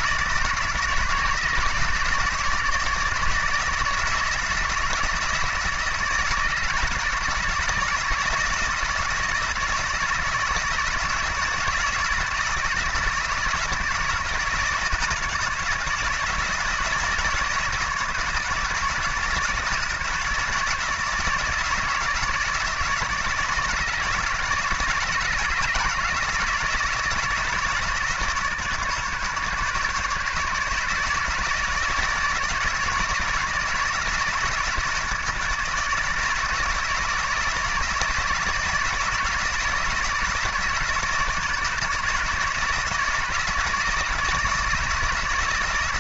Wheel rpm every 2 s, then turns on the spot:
160, 150, 160, 160, 160, 160, 160, 160, 160, 160, 160, 160, 170, 160, 150, 150, 160, 160, 160, 160, 160, 160, 160.
none